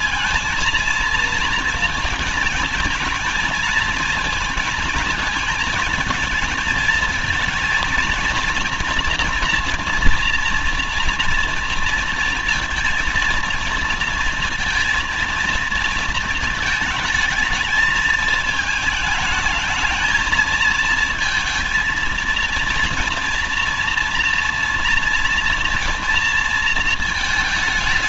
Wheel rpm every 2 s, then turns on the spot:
230, 220, 220, 220, 240, 230, 230, 230, 220, 220, 220, 230, 230, 230.
none